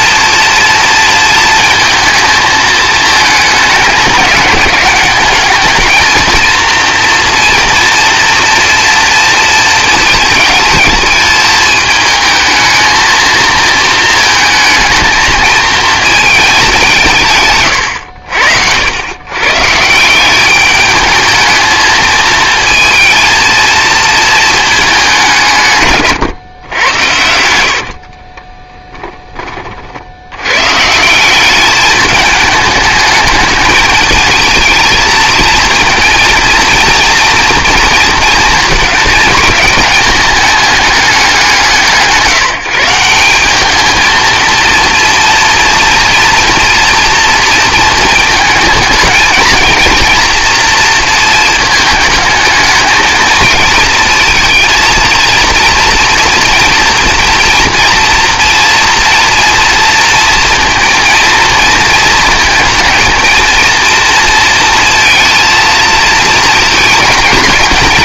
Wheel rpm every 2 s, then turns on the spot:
240, 220, 200, 230, 230, 220, 220, 220, 200, 80, 200, 230, 220, 100, 10, 130, 210, 220, 230, 220, 210, 170, 230, 230, 220, 230, 220, 230, 230, 230, 230, 220, 230, 230.
28-30